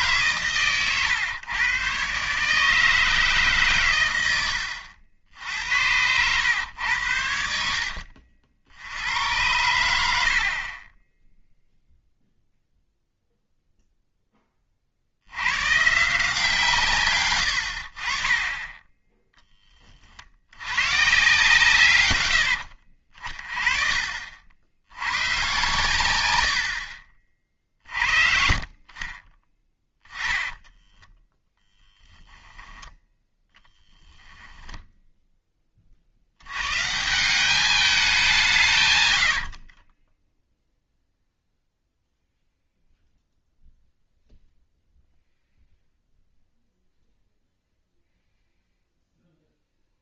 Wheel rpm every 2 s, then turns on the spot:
120, 150, 90, 100, 80, 30, 0, 40, 140, 10, 110, 60, 80, 80, 50, 10, 20, 10, 130, 140, 0, 0, 0, 0, 0.
30-32 34-36